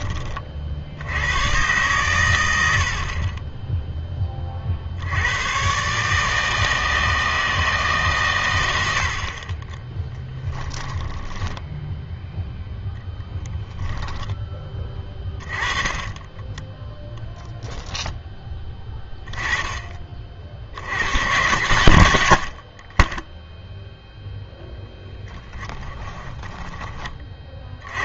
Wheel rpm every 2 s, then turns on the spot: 50, 70, 50, 160, 100, 10, 0, 20, 20, 20, 80, 50, 10, 10.
10-12 14-18 26-28